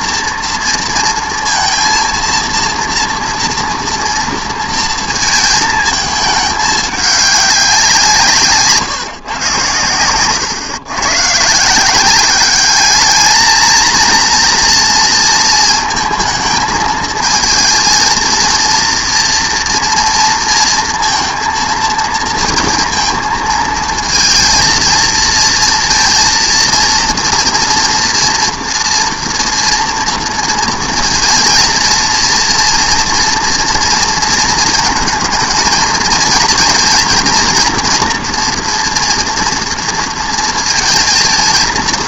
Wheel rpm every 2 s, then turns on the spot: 230, 230, 230, 210, 160, 120, 200, 230, 220, 230, 230, 230, 230, 230, 240, 230, 230, 230, 230, 230, 230.
none